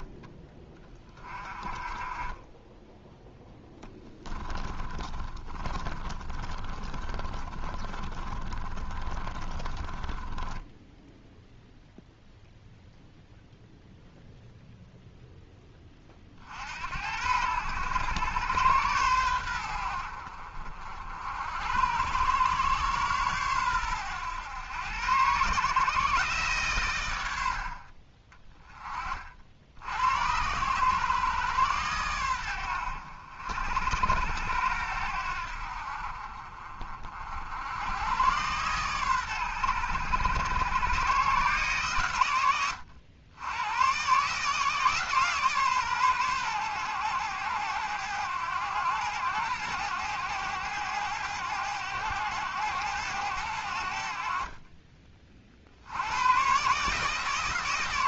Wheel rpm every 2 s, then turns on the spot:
20, 10, 20, 40, 40, 10, 0, 0, 60, 110, 60, 120, 110, 120, 30, 110, 90, 90, 40, 120, 110, 100, 150, 120, 100, 100, 100, 40, 130.
2-12